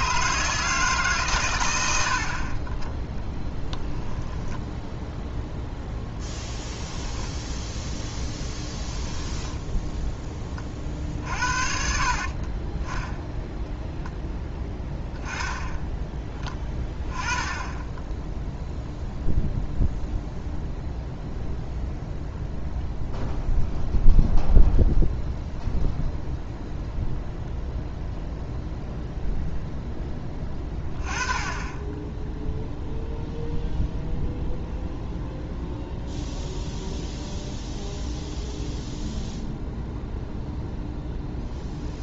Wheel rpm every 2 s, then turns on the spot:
150, 40, 0, 10, 10, 30, 20, 10, 10, 0, 0, 0, 0, 0, 0, 20, 0, 0, 0, 0, 0.
6-8